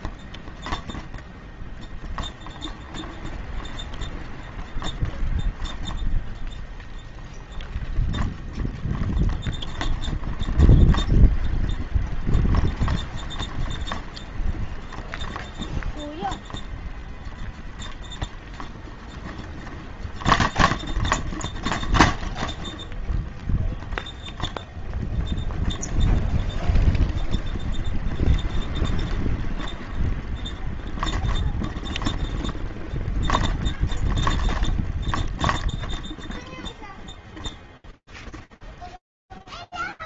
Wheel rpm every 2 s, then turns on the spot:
0, 0, 0, 0, 0, 0, 0, 0, 0, 0, 0, 0, 0, 0, 0, 0, 0, 0, 0, 0.
none